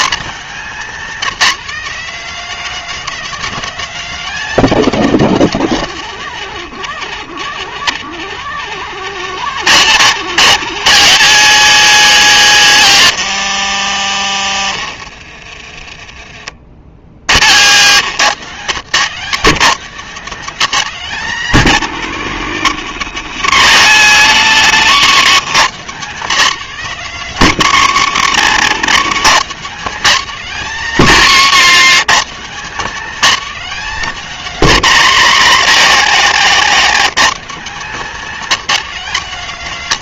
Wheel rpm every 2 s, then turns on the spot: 200, 240, 240, 210, 180, 150, 90, 30, 40, 160, 210, 180, 180, 200, 190, 220, 220, 180, 140, 220.
28-30